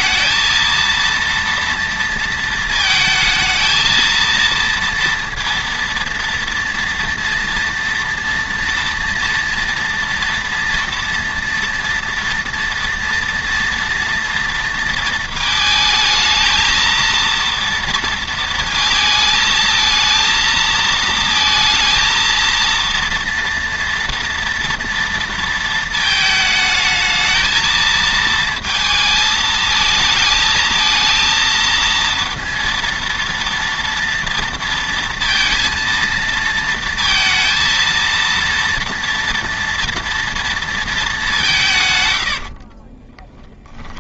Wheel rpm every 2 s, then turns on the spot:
230, 230, 230, 230, 230, 230, 230, 230, 230, 230, 230, 230, 230, 220, 230, 220, 230, 230, 230, 230, 230, 50.
42-44